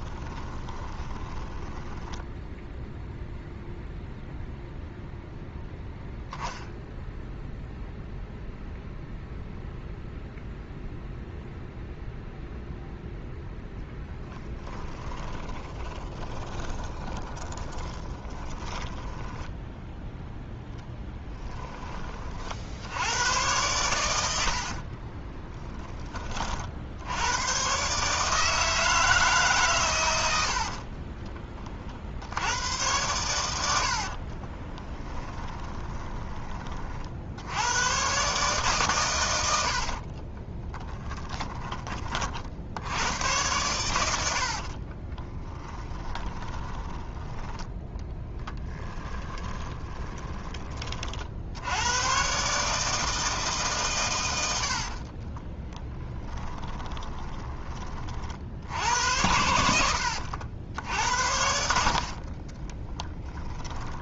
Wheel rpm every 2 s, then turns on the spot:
20, 0, 0, 10, 0, 0, 0, 10, 20, 10, 10, 80, 40, 60, 160, 50, 100, 20, 30, 130, 20, 80, 40, 30, 10, 30, 150, 60, 20, 80, 80, 20.
0-2 14-18 20-22 24-26 30-32 34-36 40-42 44-50 54-58 62-64